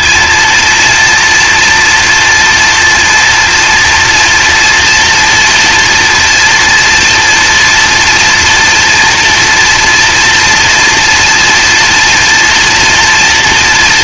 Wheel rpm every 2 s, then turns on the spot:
230, 230, 230, 230, 240, 230, 240.
none